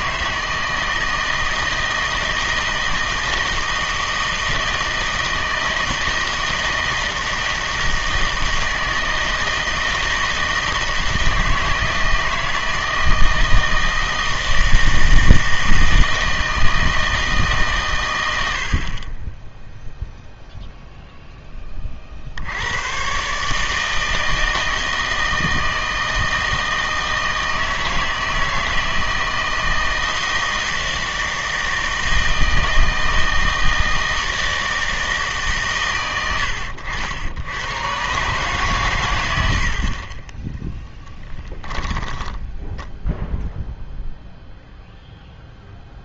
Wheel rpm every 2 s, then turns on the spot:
160, 160, 160, 160, 160, 160, 160, 160, 160, 80, 0, 80, 160, 160, 160, 160, 160, 160, 90, 130, 10, 10, 0.
none